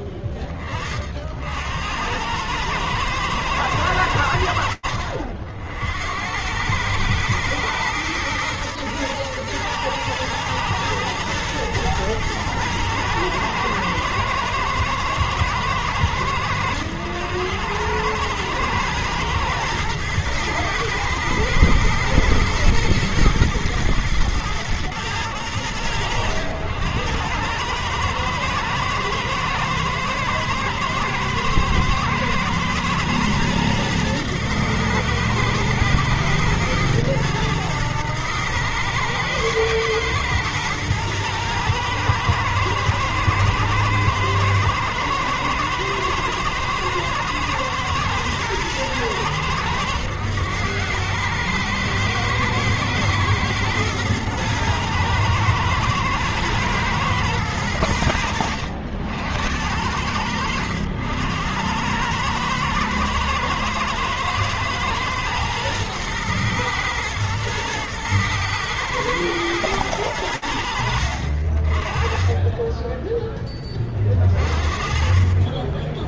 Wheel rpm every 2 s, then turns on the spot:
20, 110, 70, 100, 120, 110, 110, 110, 100, 110, 110, 120, 100, 100, 110, 110, 110, 110, 110, 110, 110, 120, 110, 110, 110, 100, 110, 110, 110, 80, 90, 110, 110, 110, 110, 60, 10, 30.
none